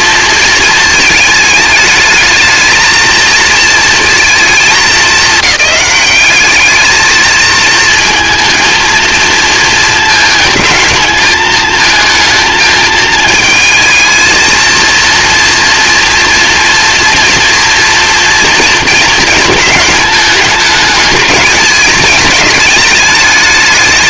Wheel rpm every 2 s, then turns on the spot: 230, 220, 220, 210, 230, 220, 220, 230, 230, 230, 210, 210.
none